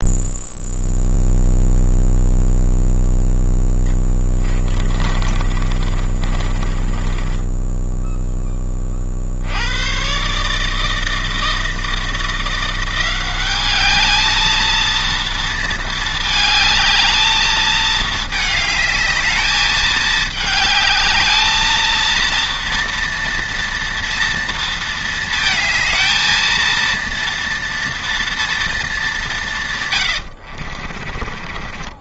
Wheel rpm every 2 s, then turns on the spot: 0, 0, 20, 20, 20, 150, 170, 220, 220, 210, 220, 230, 230, 230, 230, 70.
4-8 30-32